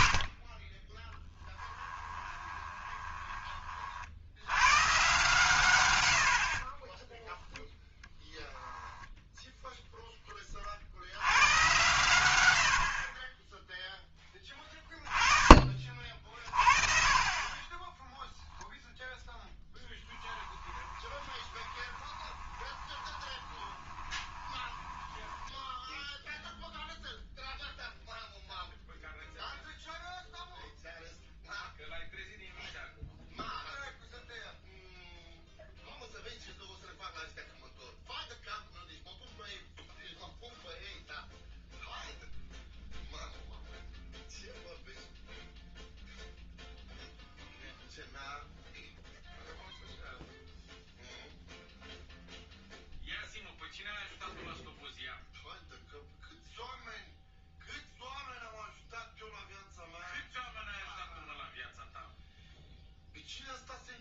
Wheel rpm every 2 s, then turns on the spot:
20, 20, 110, 20, 0, 20, 90, 20, 40, 0, 10, 20, 20, 0, 0, 0, 0, 0, 0, 0, 0, 0, 0, 0, 0, 0, 0, 0, 0, 0, 0, 0.
2-4 6-8 12-14 20-26